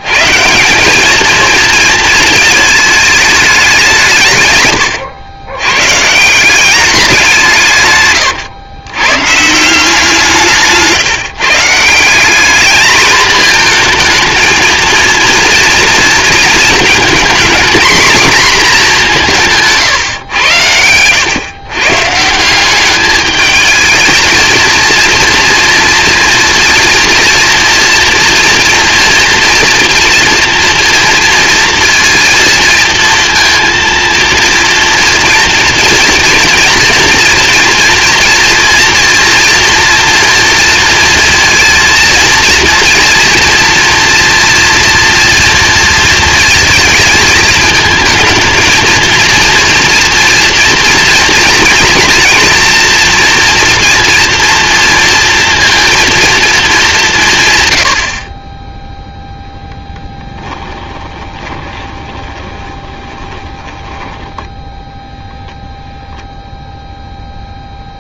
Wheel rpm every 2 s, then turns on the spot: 90, 220, 140, 170, 130, 170, 200, 220, 230, 240, 120, 170, 220, 230, 230, 230, 230, 230, 230, 230, 230, 230, 230, 230, 220, 230, 230, 230, 220, 30, 10, 20, 10, 0.
60-66